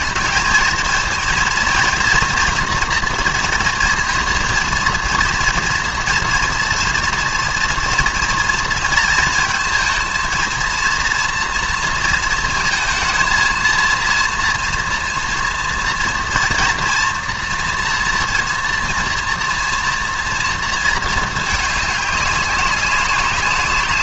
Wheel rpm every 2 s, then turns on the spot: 220, 240, 230, 230, 230, 230, 220, 230, 240, 230, 230, 190.
none